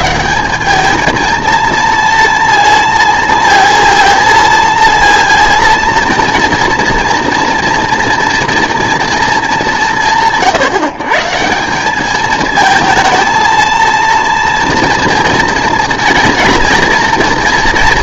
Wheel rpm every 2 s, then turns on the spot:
190, 230, 230, 230, 240, 150, 220, 230, 230.
none